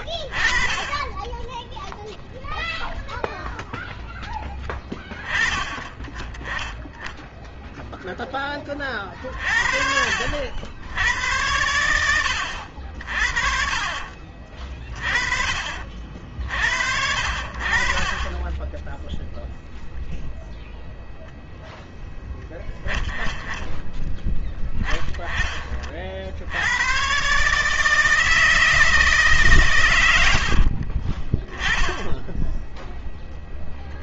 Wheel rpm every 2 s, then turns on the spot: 10, 0, 20, 10, 40, 80, 50, 30, 60, 10, 0, 10, 10, 110, 160, 40, 0.
18-20